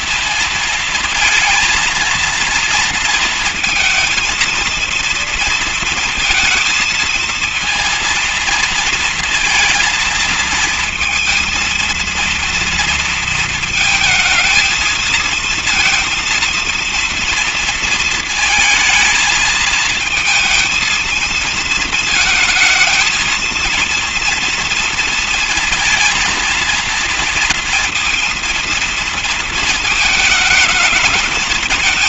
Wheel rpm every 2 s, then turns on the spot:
230, 230, 230, 230, 230, 220, 230, 220, 230, 220, 220, 220, 230, 230, 230, 220.
none